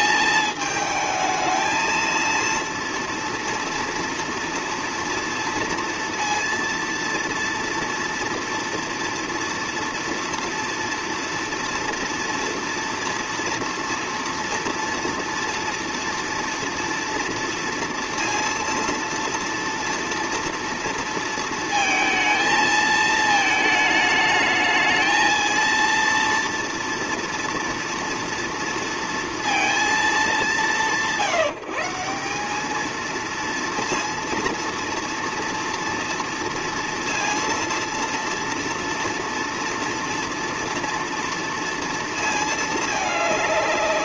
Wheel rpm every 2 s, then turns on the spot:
220, 230, 230, 230, 230, 230, 230, 230, 230, 230, 230, 220, 220, 230, 230, 170, 190, 230, 230, 230, 230, 220.
none